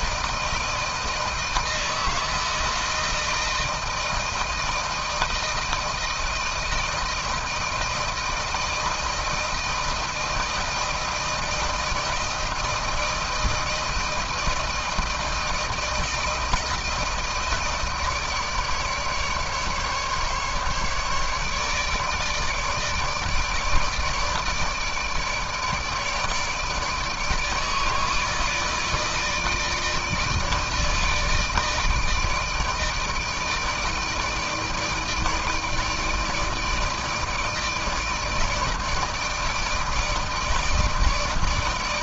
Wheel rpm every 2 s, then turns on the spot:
160, 160, 160, 160, 160, 160, 160, 160, 160, 150, 150, 150, 160, 160, 150, 160, 160, 160, 160, 160, 160.
none